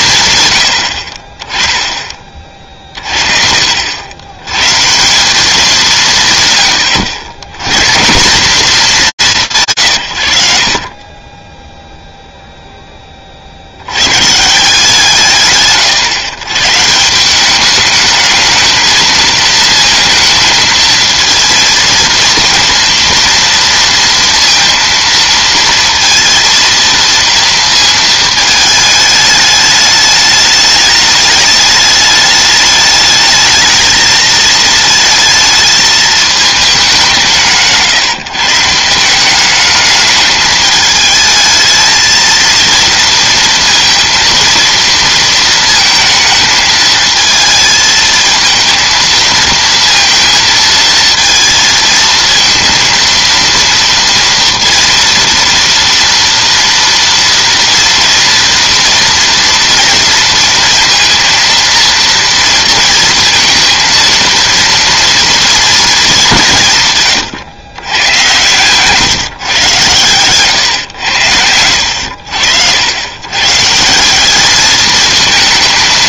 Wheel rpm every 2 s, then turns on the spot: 100, 40, 130, 100, 190, 70, 0, 150, 140, 220, 220, 230, 230, 230, 220, 210, 210, 220, 210, 160, 220, 230, 230, 220, 230, 230, 230, 230, 230, 230, 230, 230, 230, 160, 120, 120, 80, 210.
70-72